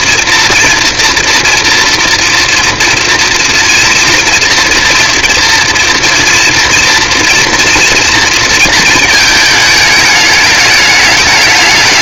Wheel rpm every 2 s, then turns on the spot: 230, 230, 230, 230, 220, 210.
none